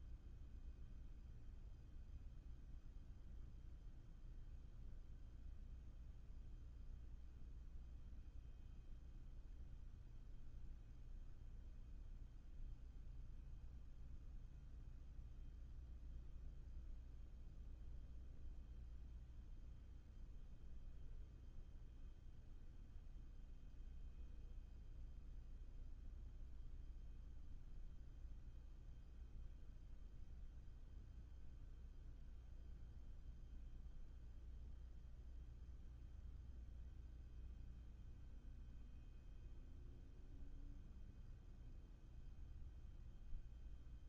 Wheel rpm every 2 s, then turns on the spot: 0, 0, 0, 0, 0, 0, 0, 0, 0, 0, 0, 0, 0, 0, 0, 0, 0, 0, 0, 0, 0, 0.
none